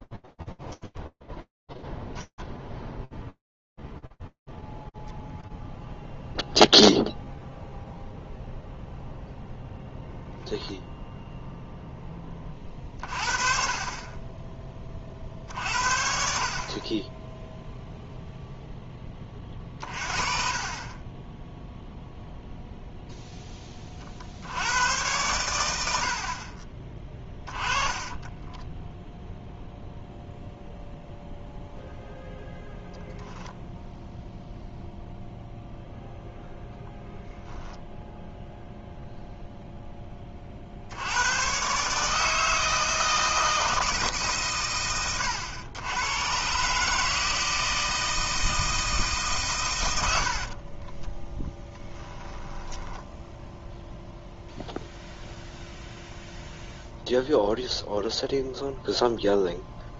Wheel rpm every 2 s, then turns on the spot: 0, 10, 20, 10, 30, 10, 40, 0, 40, 0, 20, 110, 20, 0, 0, 0, 0, 0, 0, 60, 160, 100, 150, 160, 30, 10, 0, 0, 0, 0.
16-18 24-26 48-52